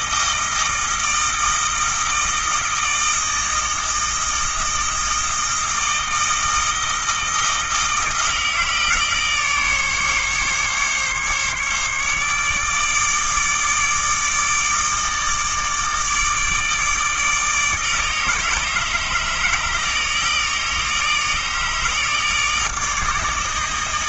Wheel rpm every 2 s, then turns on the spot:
160, 160, 160, 160, 160, 140, 150, 160, 150, 150, 150, 150.
none